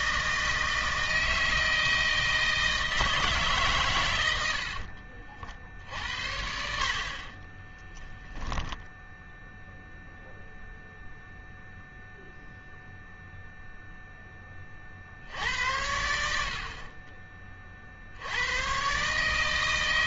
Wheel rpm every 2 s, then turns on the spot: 160, 160, 60, 60, 0, 0, 0, 50, 40, 120.
4-6